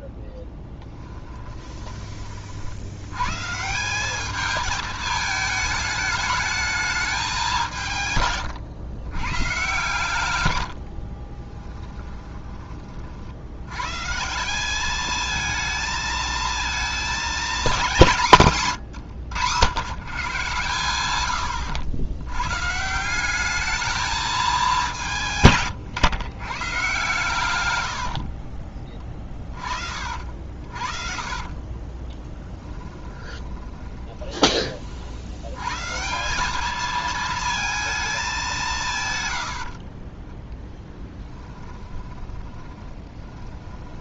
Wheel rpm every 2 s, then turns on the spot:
20, 70, 220, 210, 110, 60, 40, 210, 220, 130, 110, 150, 200, 120, 20, 40, 10, 40, 210, 170, 10, 20.
0-2 10-12 28-30 32-34 40-44